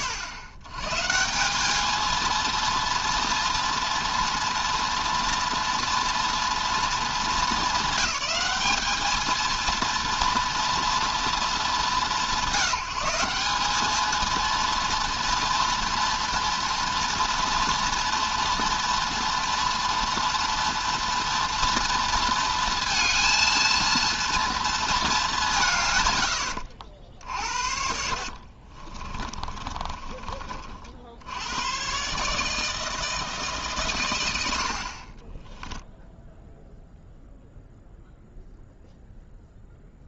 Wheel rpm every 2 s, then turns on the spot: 110, 230, 240, 230, 210, 240, 190, 230, 230, 240, 240, 230, 220, 80, 30, 60, 160, 60, 0, 0.
26-30